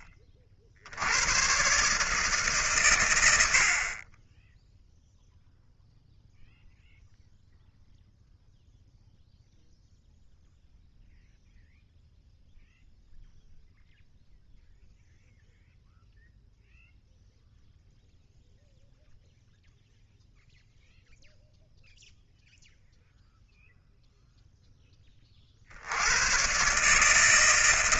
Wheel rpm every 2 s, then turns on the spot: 60, 130, 0, 0, 0, 0, 0, 0, 0, 0, 0, 0, 10, 140.
none